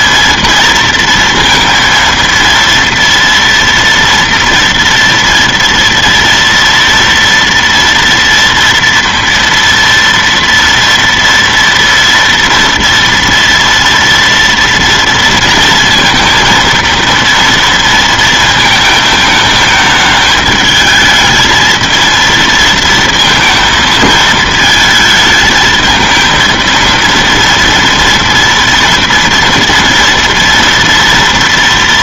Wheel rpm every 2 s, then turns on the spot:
230, 230, 230, 230, 230, 230, 240, 230, 230, 220, 210, 230, 220, 220, 230, 230.
none